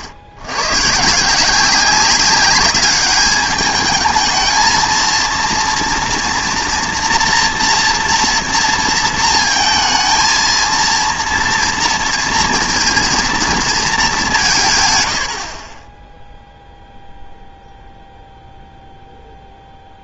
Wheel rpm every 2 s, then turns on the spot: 80, 200, 220, 230, 230, 230, 230, 170, 0, 0.
none